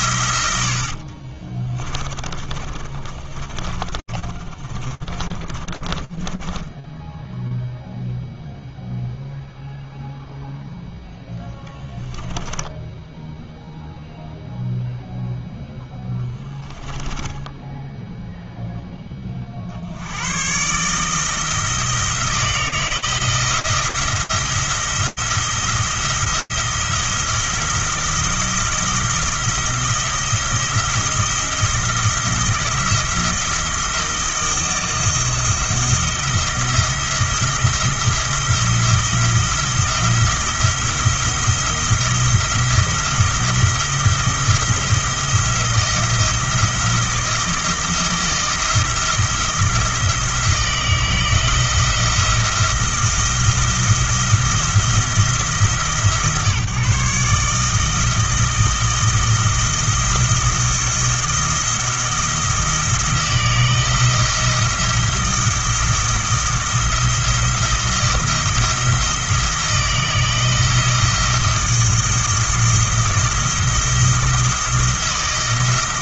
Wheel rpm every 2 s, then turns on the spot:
80, 30, 30, 10, 0, 0, 0, 0, 10, 50, 160, 160, 170, 170, 170, 170, 170, 170, 170, 170, 170, 170, 170, 170, 170, 160, 170, 160, 150, 170, 170, 160, 170, 170, 160, 170, 170, 170.
2-8